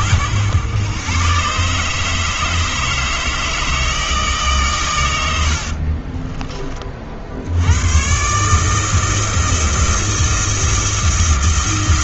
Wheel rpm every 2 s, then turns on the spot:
120, 160, 120, 30, 160, 160.
none